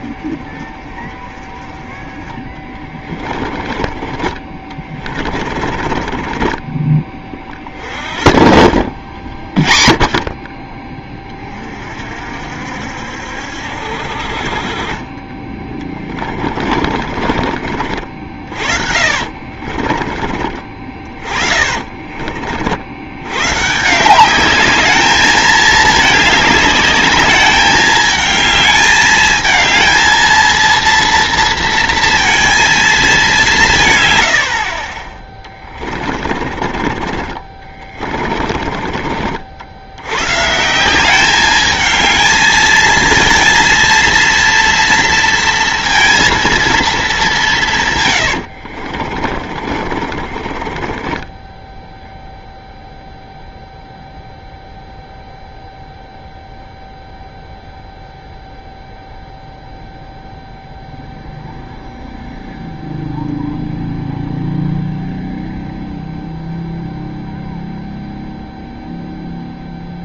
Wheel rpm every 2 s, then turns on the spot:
30, 20, 30, 40, 50, 20, 60, 40, 30, 60, 30, 60, 200, 210, 220, 230, 220, 60, 20, 40, 170, 220, 230, 230, 80, 30, 0, 0, 0, 0, 0, 0, 0, 0, 0.
2-6 16-20 48-52